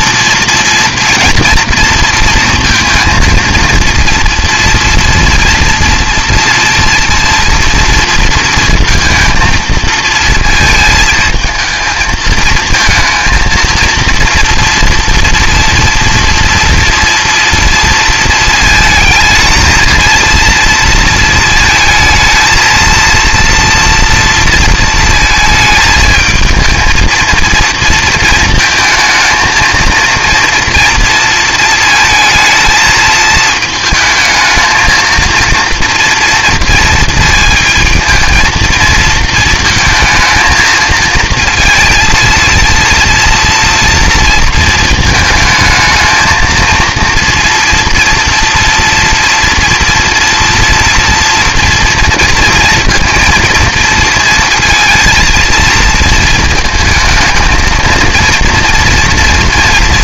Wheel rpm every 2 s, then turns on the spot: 230, 230, 230, 230, 230, 220, 220, 230, 230, 220, 230, 230, 230, 220, 230, 230, 220, 220, 230, 230, 220, 230, 230, 220, 230, 230, 230, 230, 230, 230.
none